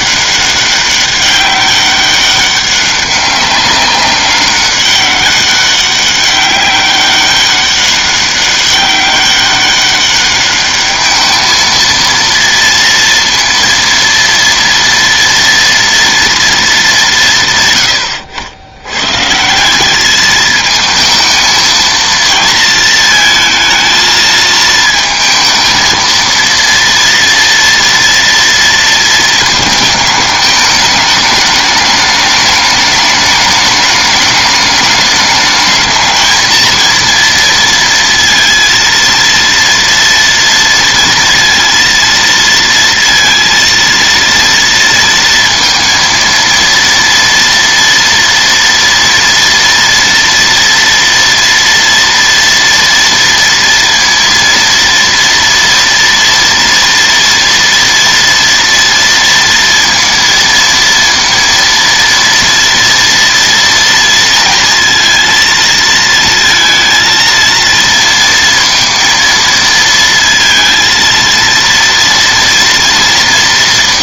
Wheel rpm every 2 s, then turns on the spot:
200, 200, 190, 200, 200, 210, 230, 230, 220, 100, 220, 220, 220, 230, 230, 210, 210, 210, 230, 230, 230, 230, 230, 230, 240, 230, 230, 230, 230, 230, 230, 230, 230, 230, 230, 220, 230.
none